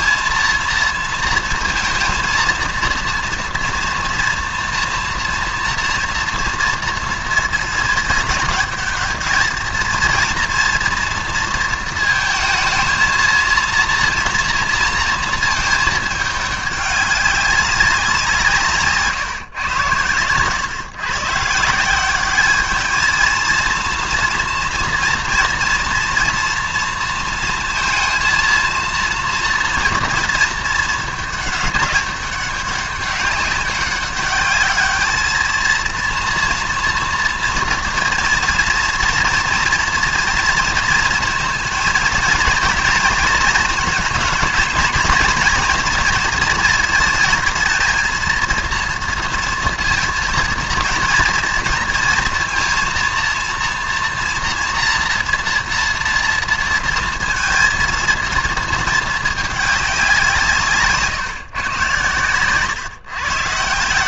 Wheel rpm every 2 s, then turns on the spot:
230, 230, 230, 230, 210, 230, 220, 230, 200, 160, 110, 210, 230, 230, 230, 220, 200, 200, 230, 230, 230, 230, 220, 230, 230, 230, 230, 230, 230, 220, 160, 130.
none